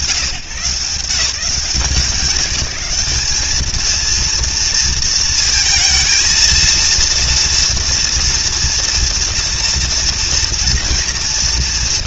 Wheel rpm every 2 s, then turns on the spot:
130, 180, 230, 230, 240, 230.
none